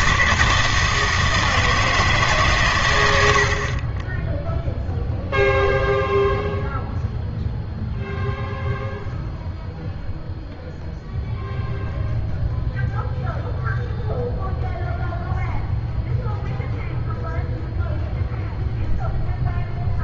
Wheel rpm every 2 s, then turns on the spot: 160, 130, 0, 0, 0, 0, 0, 0, 0, 0.
none